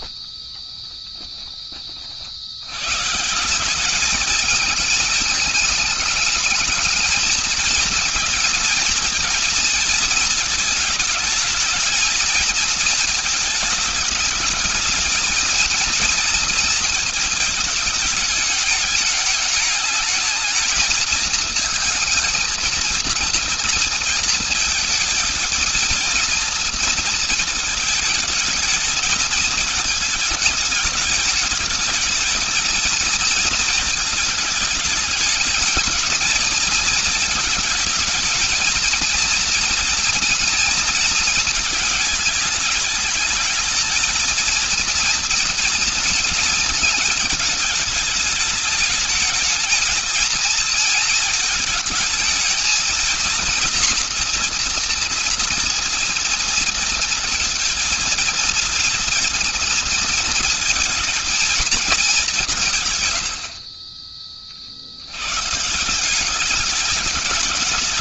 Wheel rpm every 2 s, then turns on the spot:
20, 100, 220, 220, 220, 220, 220, 220, 230, 210, 220, 230, 230, 230, 220, 220, 220, 220, 220, 230, 230, 220, 230, 230, 210, 220, 220, 230, 230, 230, 230, 190, 40, 180.
0-2